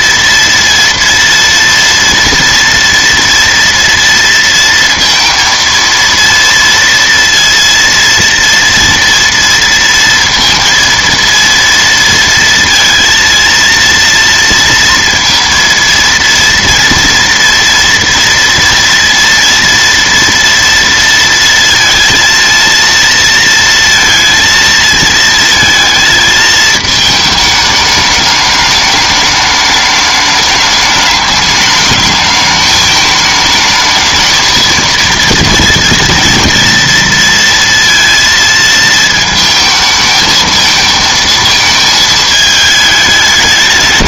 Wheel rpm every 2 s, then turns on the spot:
230, 230, 230, 230, 230, 230, 230, 230, 230, 230, 230, 230, 220, 220, 210, 210, 220, 220, 230, 220, 220, 210.
none